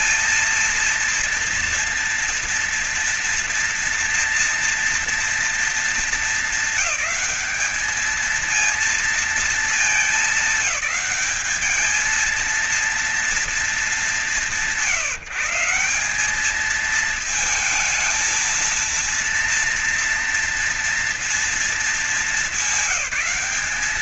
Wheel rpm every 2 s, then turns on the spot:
230, 230, 230, 200, 230, 210, 230, 170, 220, 230, 230, 200.
none